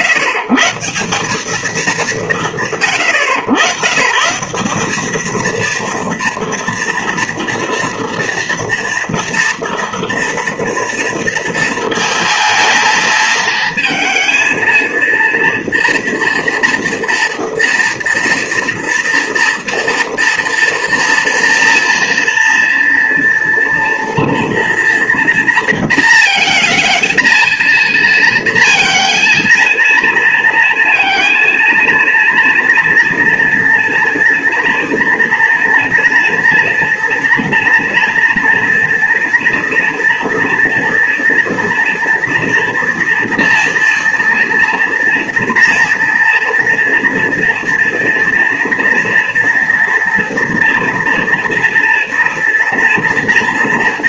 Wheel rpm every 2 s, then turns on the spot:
150, 100, 180, 230, 230, 230, 220, 230, 230, 230, 230, 230, 230, 230, 230, 230, 240, 230, 230, 240, 230, 230, 230, 230, 240, 230, 230.
none